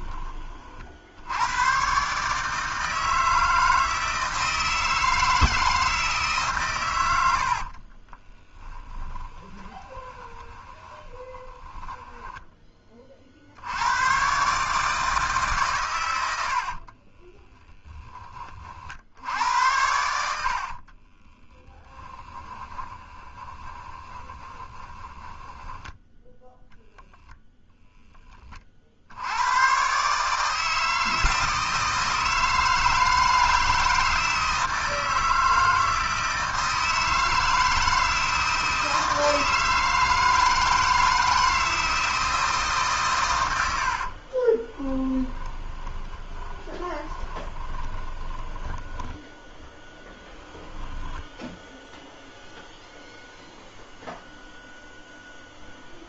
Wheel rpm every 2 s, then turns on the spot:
50, 160, 160, 100, 10, 20, 30, 150, 40, 50, 40, 20, 20, 0, 50, 160, 160, 160, 160, 160, 160, 130, 10, 20, 10, 0, 0, 0.
8-12 16-18 20-26 44-50